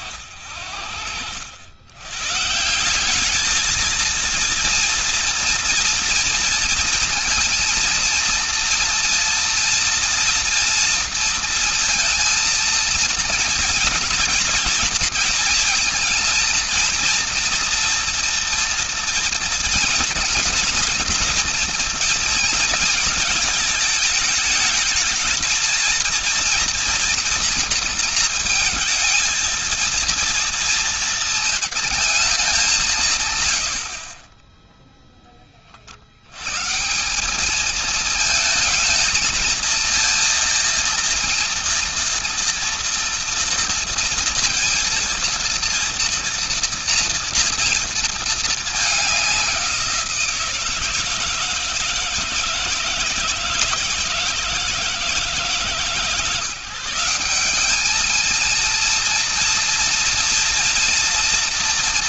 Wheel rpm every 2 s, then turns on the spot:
50, 160, 230, 230, 230, 230, 230, 230, 230, 230, 240, 230, 210, 230, 230, 230, 190, 10, 150, 220, 230, 230, 230, 230, 210, 160, 160, 160, 170, 230, 230.
none